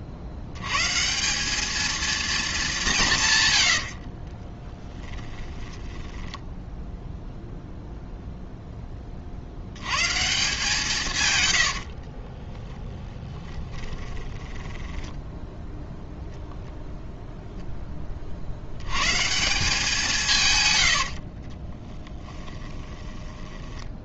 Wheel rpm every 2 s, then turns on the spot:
90, 220, 30, 10, 0, 160, 20, 10, 0, 80, 130, 10.
4-8 12-16 20-24